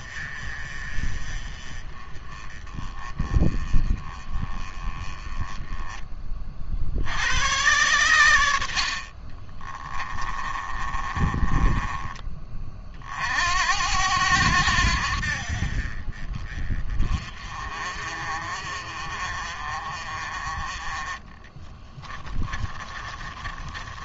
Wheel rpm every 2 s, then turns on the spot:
30, 20, 20, 70, 50, 20, 40, 70, 30, 40, 20, 30.
8-12 22-24